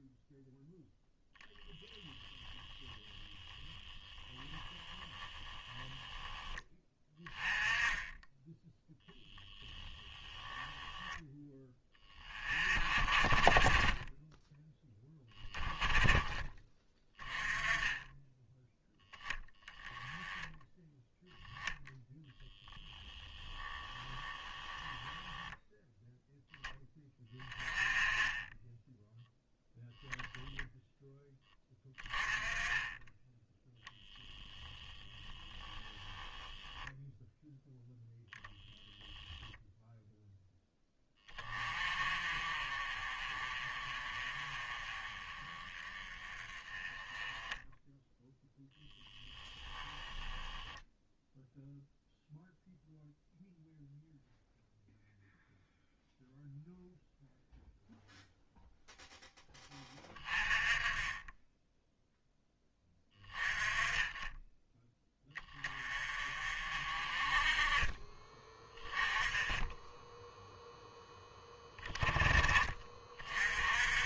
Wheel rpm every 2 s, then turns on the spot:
0, 10, 10, 10, 10, 10, 30, 10, 20, 10, 10, 10, 10, 10, 10, 10, 20, 10, 0, 0, 10, 30, 30, 20, 0, 0, 0, 0, 0, 0, 30, 10, 10, 40, 20, 0, 20.
2-6 24-26 34-36